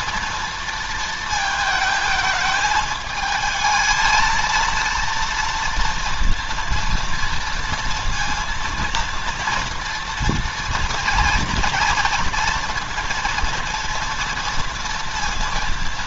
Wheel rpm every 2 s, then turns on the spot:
230, 220, 230, 230, 230, 230, 230, 230.
none